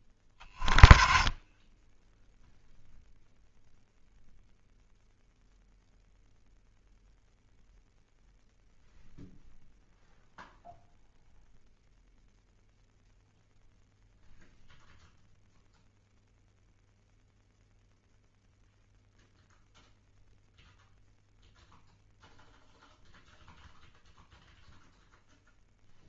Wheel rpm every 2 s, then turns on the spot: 20, 0, 0, 0, 0, 0, 0, 0, 0, 0, 0, 0, 0.
none